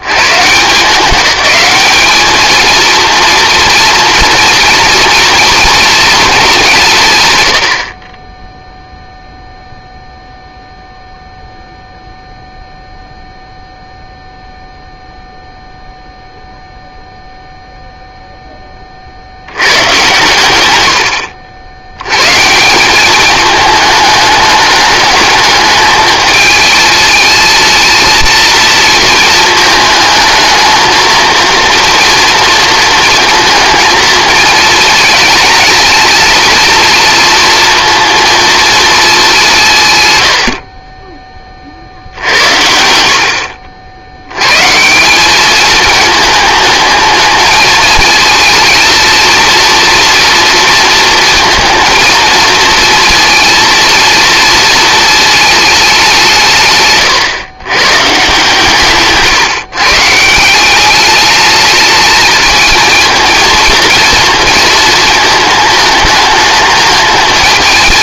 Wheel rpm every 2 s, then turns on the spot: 160, 220, 230, 180, 0, 0, 0, 0, 0, 20, 110, 170, 210, 220, 230, 220, 230, 220, 230, 230, 50, 70, 150, 220, 230, 230, 230, 230, 150, 150, 190, 220, 230, 220.
56-58